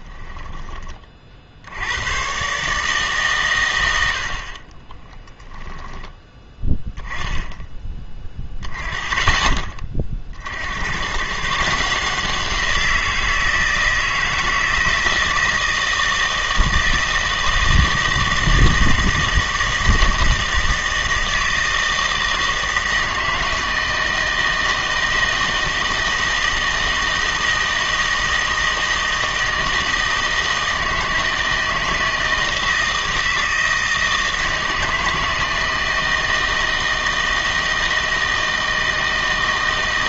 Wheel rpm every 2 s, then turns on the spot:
20, 130, 30, 10, 20, 60, 170, 160, 160, 160, 160, 160, 160, 160, 160, 160, 160, 160, 160, 160.
4-6